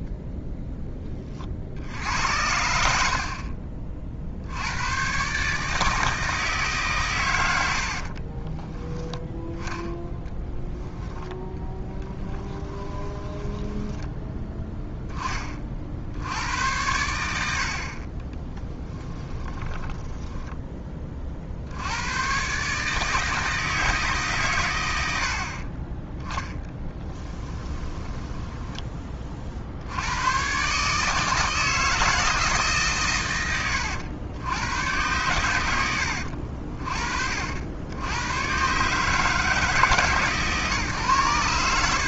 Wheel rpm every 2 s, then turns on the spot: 10, 70, 110, 140, 10, 10, 10, 10, 90, 10, 20, 150, 100, 10, 20, 150, 130, 110, 40, 140, 130.
12-14 18-20 26-28